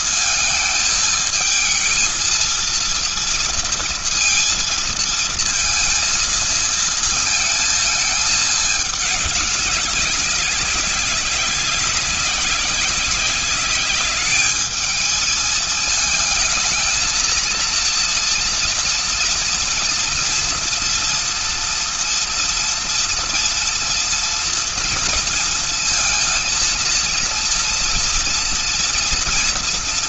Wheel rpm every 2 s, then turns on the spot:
220, 230, 230, 230, 200, 190, 200, 220, 220, 230, 230, 230, 230, 230, 230.
none